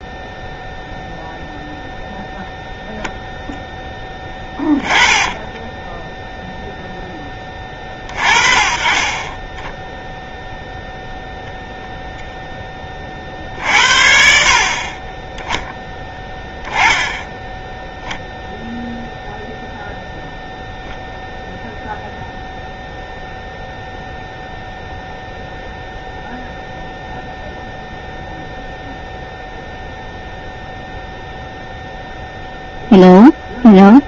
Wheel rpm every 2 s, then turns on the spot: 0, 0, 20, 0, 30, 0, 30, 40, 0, 0, 0, 0, 0, 0, 0, 0, 0.
4-6